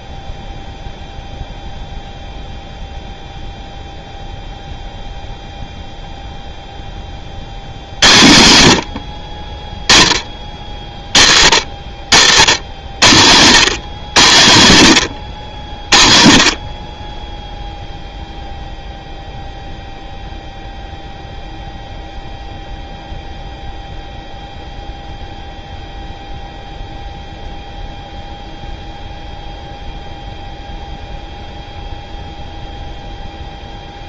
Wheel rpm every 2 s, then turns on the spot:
0, 0, 0, 0, 90, 30, 90, 80, 30, 0, 0, 0, 0, 0, 0, 0, 0.
none